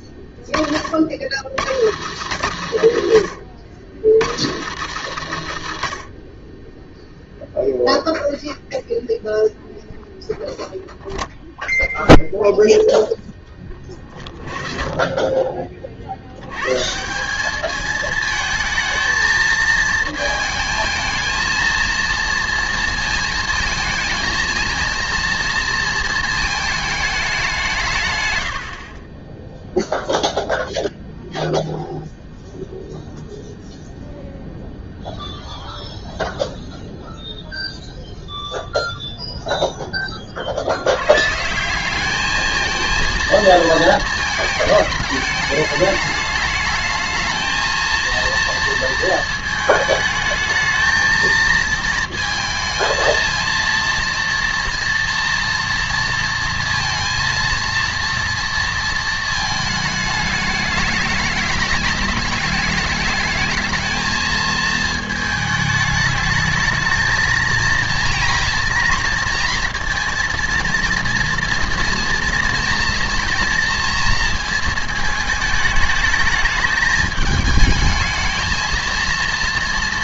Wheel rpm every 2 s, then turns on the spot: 40, 110, 130, 10, 0, 0, 0, 30, 130, 220, 220, 230, 220, 220, 70, 0, 0, 0, 0, 0, 80, 220, 210, 220, 230, 220, 220, 230, 230, 230, 210, 210, 220, 220, 240, 230, 230, 220, 210, 230.
none